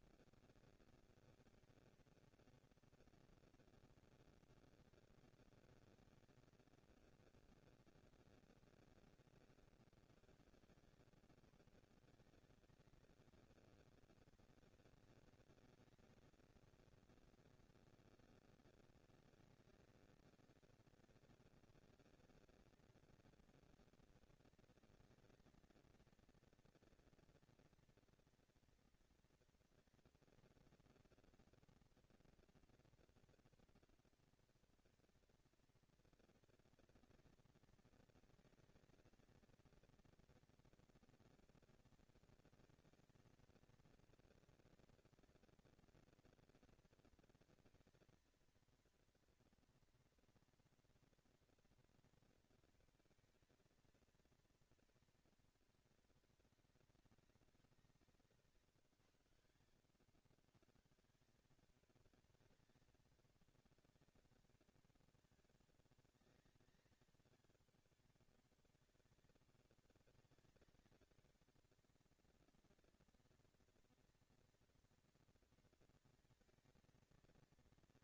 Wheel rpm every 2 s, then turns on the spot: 230, 230, 230, 220, 190, 110, 170, 210, 230, 230, 230, 220, 220, 230, 230, 230, 230, 230, 230, 230, 230, 230, 230, 230, 230, 230, 230, 230, 200, 150, 100, 200, 200, 200, 200, 190, 220, 230, 230.
58-60